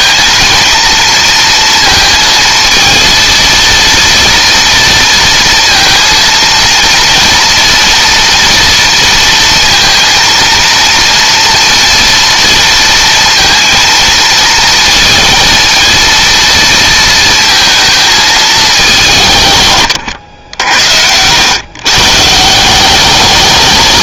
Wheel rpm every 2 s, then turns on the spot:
230, 230, 230, 230, 230, 230, 230, 230, 230, 200, 70, 190.
20-22